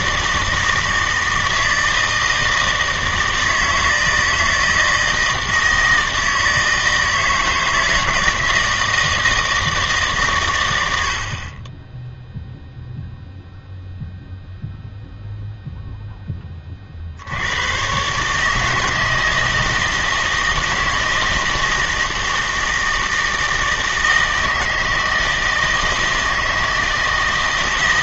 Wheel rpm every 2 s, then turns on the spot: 160, 160, 160, 160, 160, 110, 0, 0, 40, 160, 160, 160, 160, 160.
none